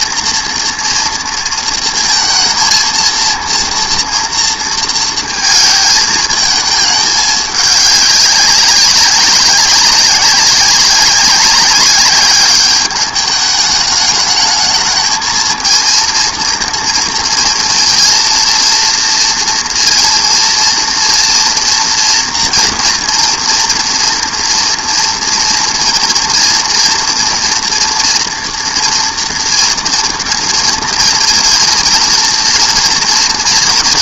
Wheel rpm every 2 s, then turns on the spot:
230, 230, 230, 220, 200, 190, 200, 220, 230, 230, 230, 230, 230, 230, 230, 230, 230.
none